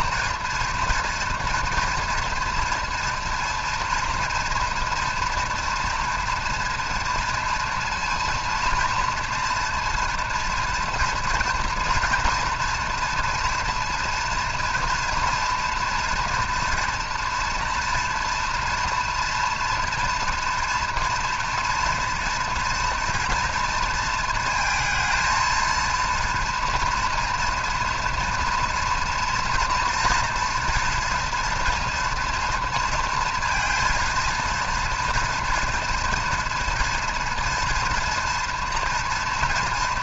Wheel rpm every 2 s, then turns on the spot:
230, 230, 240, 230, 230, 230, 230, 230, 230, 230, 230, 230, 230, 240, 230, 230, 240, 230, 230, 230.
none